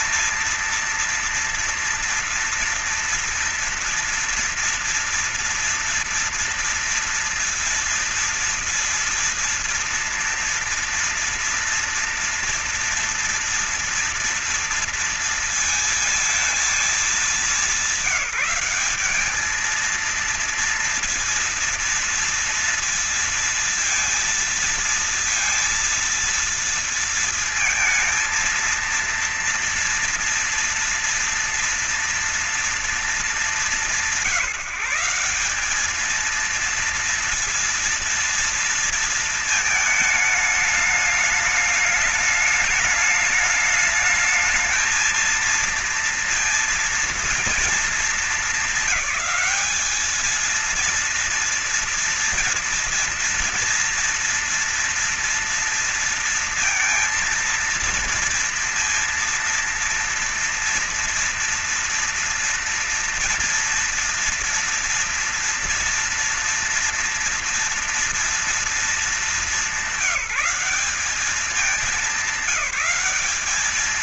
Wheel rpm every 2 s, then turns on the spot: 230, 240, 230, 230, 230, 230, 240, 230, 220, 190, 230, 230, 230, 230, 230, 230, 230, 160, 220, 230, 210, 210, 220, 230, 210, 220, 230, 230, 230, 230, 230, 230, 230, 230, 230, 200, 190.
none